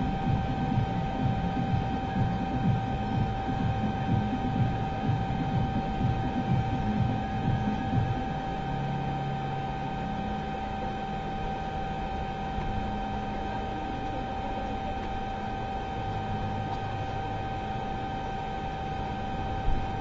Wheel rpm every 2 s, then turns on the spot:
0, 0, 0, 0, 0, 0, 0, 0, 0, 0.
none